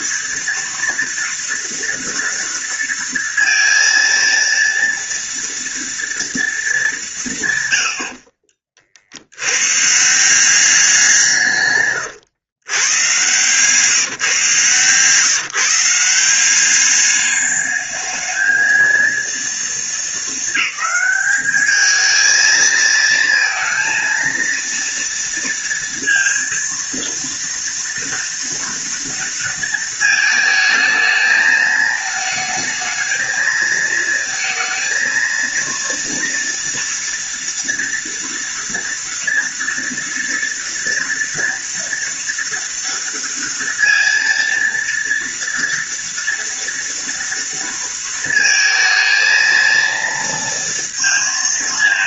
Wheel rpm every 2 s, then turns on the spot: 230, 230, 230, 220, 50, 180, 110, 140, 190, 220, 210, 220, 230, 230, 230, 220, 220, 220, 230, 230, 230, 230, 230, 230, 230, 230.
none